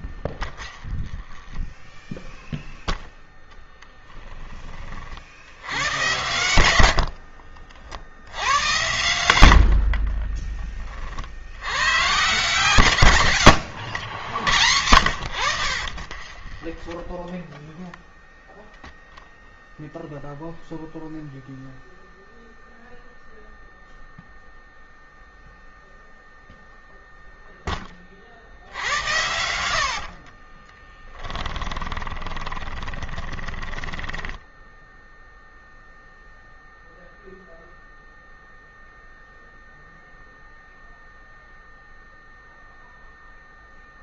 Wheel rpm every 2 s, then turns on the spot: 10, 0, 50, 70, 90, 40, 120, 90, 10, 0, 0, 0, 0, 0, 90, 20, 20, 0, 0, 0, 0, 0.
0-2 6-8 16-18 28-34